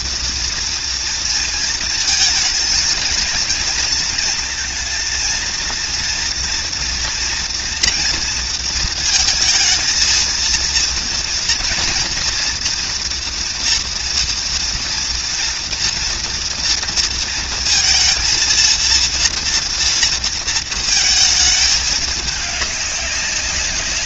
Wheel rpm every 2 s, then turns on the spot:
230, 220, 230, 230, 230, 230, 230, 230, 230, 230, 220, 200.
none